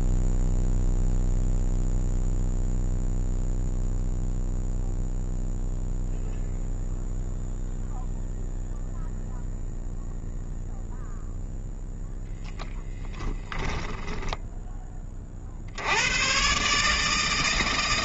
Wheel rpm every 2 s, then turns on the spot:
0, 0, 0, 0, 0, 0, 0, 20, 140.
none